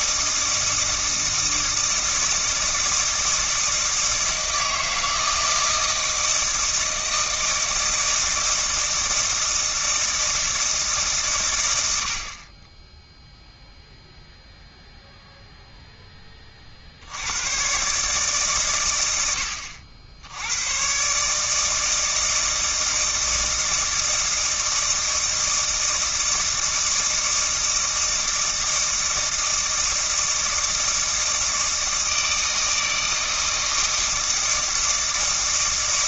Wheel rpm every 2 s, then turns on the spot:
160, 160, 160, 160, 160, 150, 10, 0, 60, 110, 110, 160, 160, 160, 160, 160, 160, 160.
none